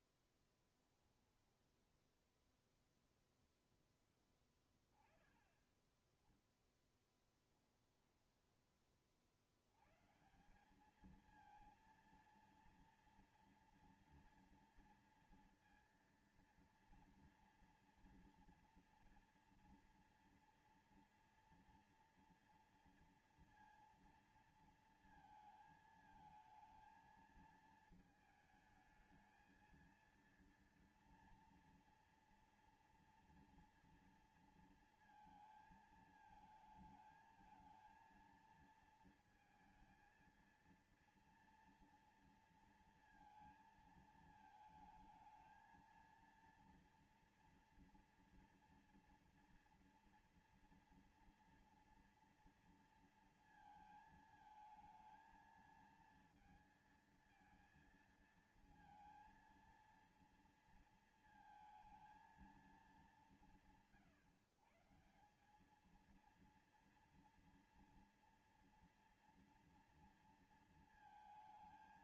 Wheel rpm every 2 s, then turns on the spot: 10, 0, 10, 0, 20, 160, 230, 230, 230, 230, 230, 230, 230, 220, 220, 230, 230, 230, 220, 230, 230, 230, 220, 230, 230, 230, 230, 220, 220, 220, 230, 180, 140, 230, 230, 230.
0-2